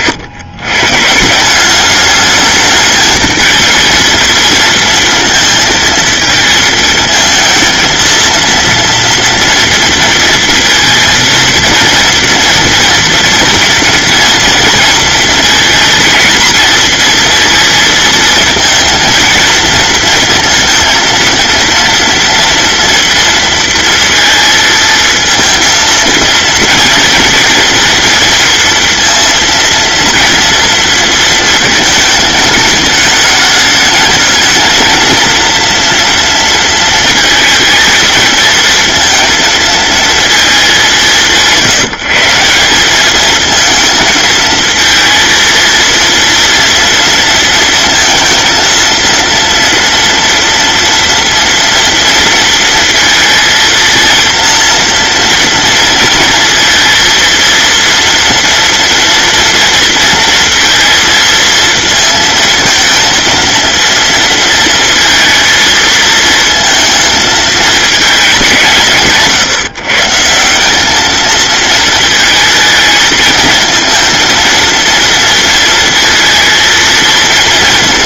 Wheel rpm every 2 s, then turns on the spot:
150, 220, 230, 220, 230, 230, 230, 230, 230, 230, 230, 230, 230, 230, 230, 230, 220, 230, 220, 230, 180, 210, 230, 230, 230, 230, 230, 230, 230, 240, 230, 230, 230, 220, 150, 210, 220, 230, 230.
none